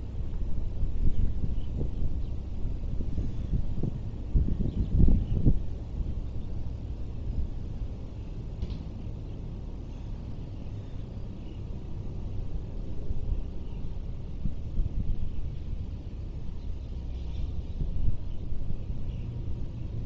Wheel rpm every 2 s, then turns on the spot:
0, 0, 0, 0, 0, 0, 0, 0, 0, 0.
none